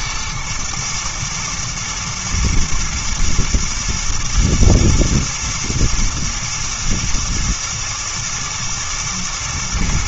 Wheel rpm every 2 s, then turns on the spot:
120, 110, 120, 120, 110.
none